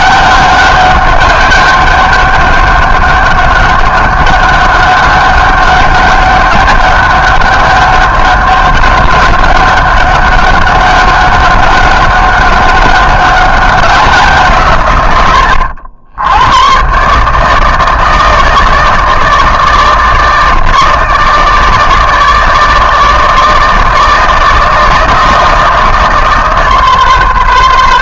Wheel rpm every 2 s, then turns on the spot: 200, 200, 200, 200, 200, 190, 200, 150, 110, 160, 160, 160, 160, 150.
none